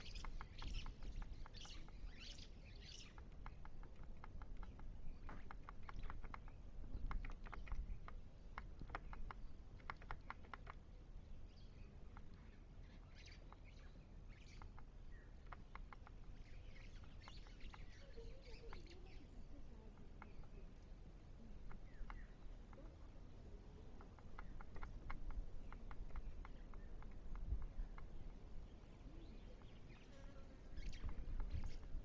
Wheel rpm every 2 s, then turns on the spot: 0, 0, 0, 0, 0, 0, 0, 0, 0, 0, 0, 0, 0, 0, 0, 0.
none